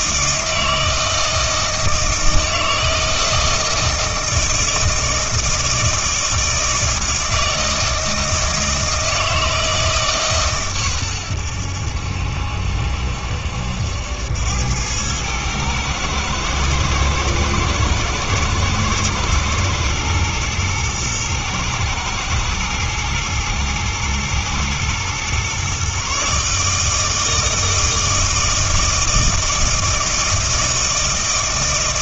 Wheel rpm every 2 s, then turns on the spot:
160, 160, 160, 160, 160, 130, 70, 90, 110, 120, 120, 120, 110, 150, 160, 160.
none